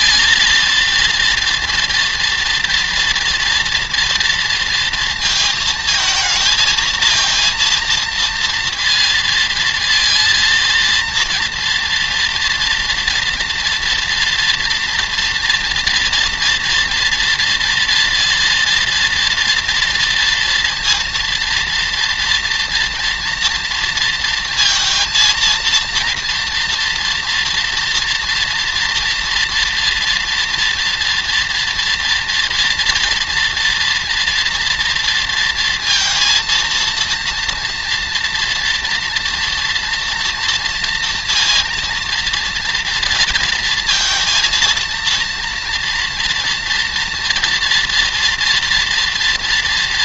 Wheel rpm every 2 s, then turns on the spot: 230, 230, 230, 220, 230, 230, 230, 230, 230, 230, 230, 230, 230, 240, 240, 240, 240, 230, 230, 230, 230, 230, 230, 230, 230.
none